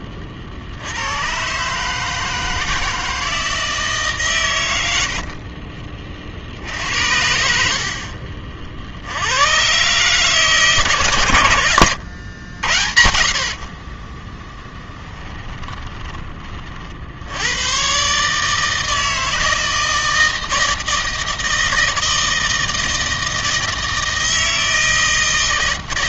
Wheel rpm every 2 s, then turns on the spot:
60, 160, 110, 60, 60, 150, 90, 10, 40, 160, 160, 160, 160.
14-16